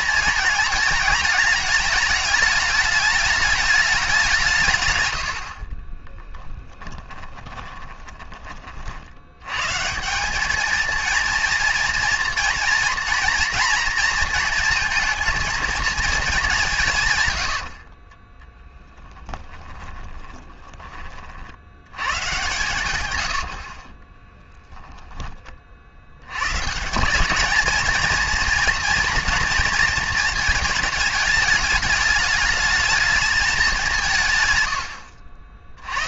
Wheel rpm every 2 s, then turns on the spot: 220, 210, 150, 30, 40, 220, 230, 230, 180, 10, 20, 110, 10, 160, 230, 220, 220, 110.
6-8 18-22 24-26